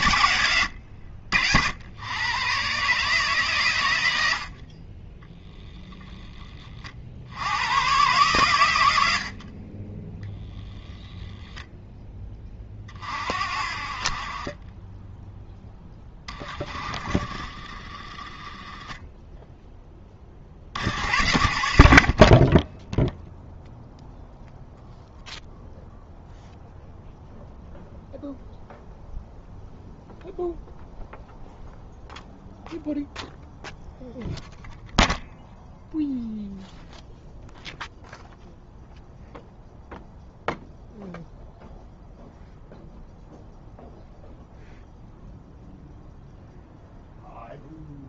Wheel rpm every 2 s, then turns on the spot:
90, 130, 40, 50, 100, 0, 40, 20, 30, 10, 70, 10, 0, 0, 0, 0, 0, 0, 0, 0, 0, 0, 0, 0.
none